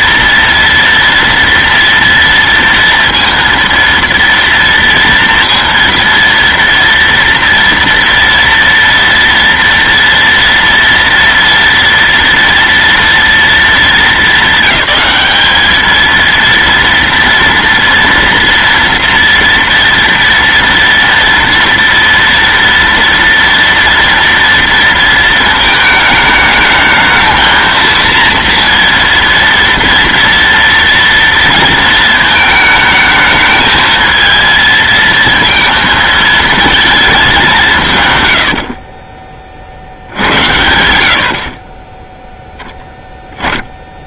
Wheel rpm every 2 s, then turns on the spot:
230, 230, 230, 230, 230, 230, 230, 210, 220, 230, 230, 230, 230, 220, 230, 230, 220, 220, 220, 120, 80, 10.
none